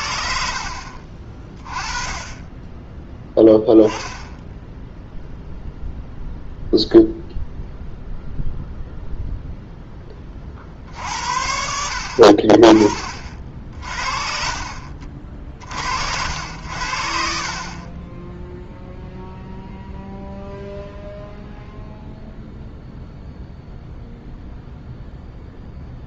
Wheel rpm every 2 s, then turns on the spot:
50, 10, 0, 0, 0, 60, 40, 60, 70, 0, 0, 0, 0.
none